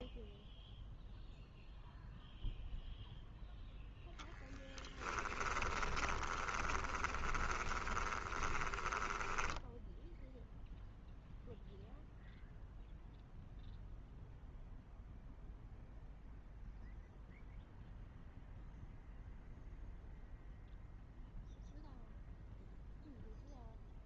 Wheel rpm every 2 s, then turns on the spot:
0, 0, 10, 20, 10, 0, 0, 0, 0, 0, 0, 0.
4-10